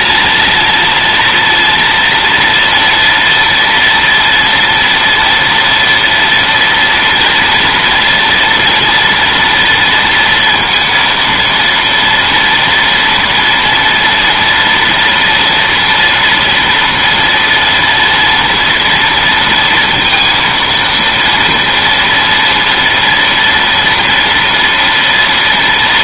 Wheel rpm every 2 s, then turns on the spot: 230, 230, 240, 230, 230, 230, 240, 230, 230, 230, 230, 230, 230.
none